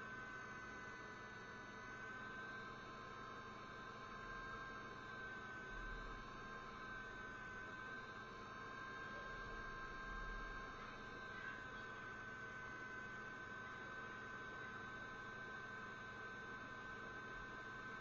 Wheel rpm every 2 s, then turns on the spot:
0, 0, 0, 0, 0, 0, 0, 0, 0.
none